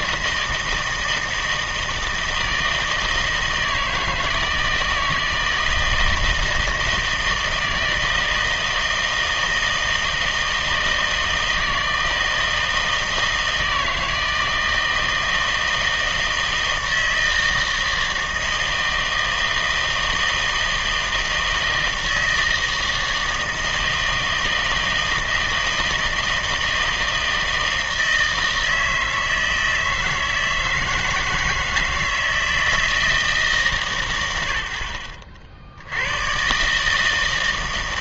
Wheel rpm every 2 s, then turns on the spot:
160, 160, 160, 160, 160, 160, 160, 160, 160, 160, 160, 160, 160, 160, 160, 160, 160, 70, 150.
none